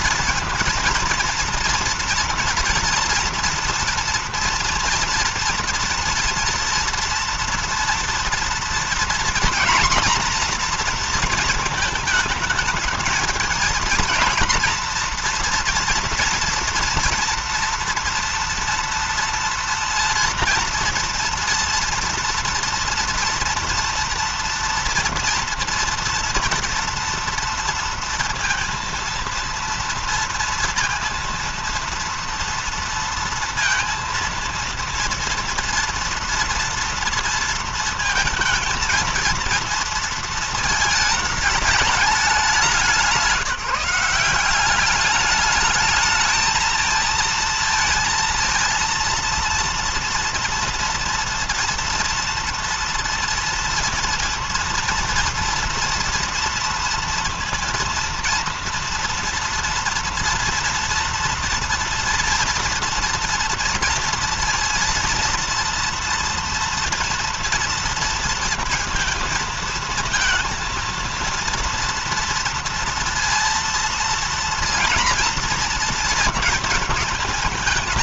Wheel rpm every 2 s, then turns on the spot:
230, 230, 240, 230, 240, 240, 220, 230, 240, 230, 230, 230, 230, 230, 230, 230, 230, 230, 230, 230, 220, 190, 190, 220, 230, 230, 230, 230, 230, 230, 230, 230, 230, 230, 230, 230, 230, 230, 220.
none